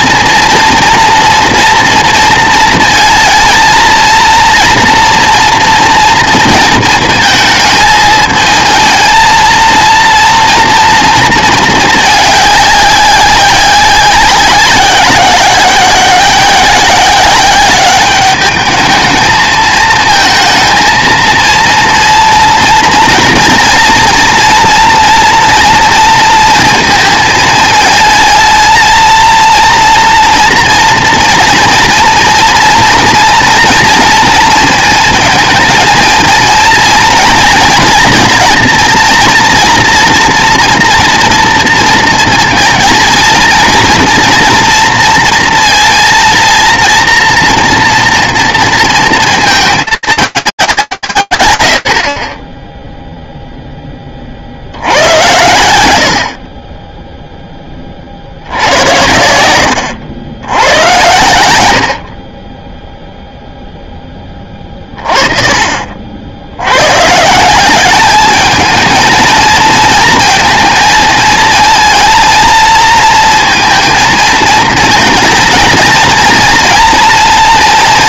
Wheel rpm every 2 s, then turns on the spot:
230, 230, 230, 230, 220, 230, 200, 190, 180, 210, 220, 230, 240, 230, 220, 230, 230, 220, 220, 230, 230, 230, 230, 230, 230, 200, 30, 70, 20, 90, 100, 10, 30, 150, 230, 230, 230, 230, 230.
none